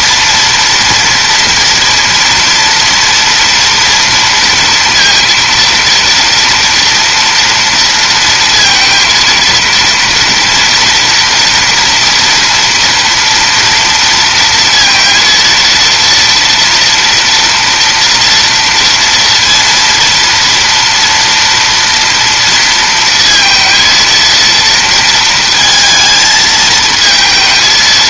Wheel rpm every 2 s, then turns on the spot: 230, 230, 230, 230, 230, 230, 230, 230, 230, 230, 230, 230, 230, 220.
none